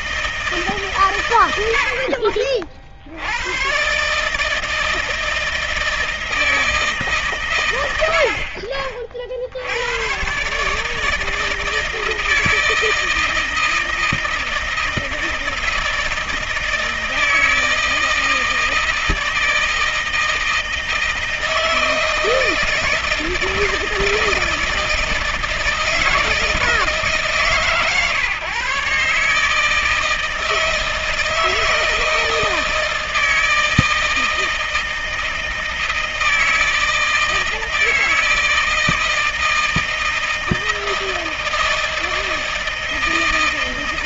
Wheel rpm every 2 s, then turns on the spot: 160, 70, 150, 160, 60, 130, 160, 160, 160, 160, 160, 160, 160, 160, 130, 160, 160, 160, 160, 160, 160, 160.
none